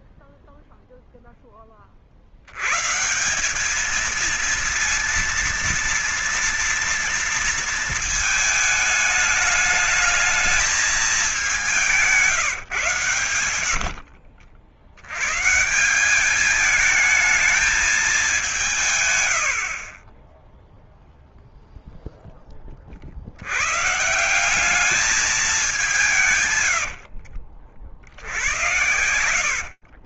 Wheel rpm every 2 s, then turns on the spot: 0, 110, 230, 230, 210, 210, 140, 90, 210, 150, 0, 60, 200, 80, 70.
26-30